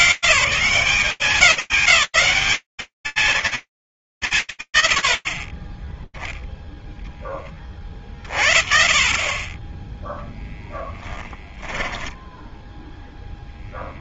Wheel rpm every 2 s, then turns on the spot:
200, 70, 20, 40, 10, 0, 120.
8-10